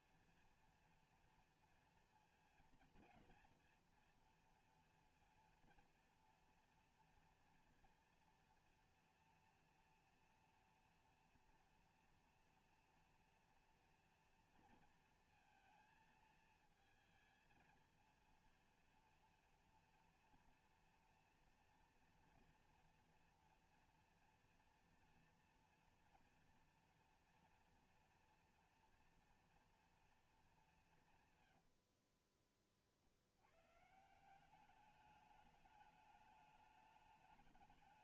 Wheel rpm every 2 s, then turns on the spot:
230, 230, 230, 230, 230, 230, 230, 230, 230, 230, 230, 230, 230, 230, 240, 210, 40, 190, 210.
32-34